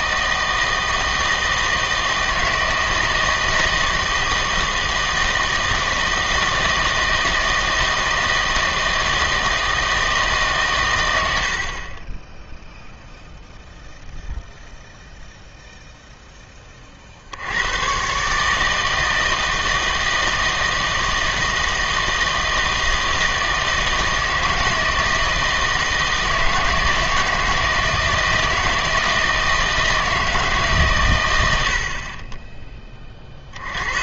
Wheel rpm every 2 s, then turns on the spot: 160, 160, 160, 160, 160, 120, 0, 0, 20, 160, 160, 160, 160, 160, 160, 140, 20.
none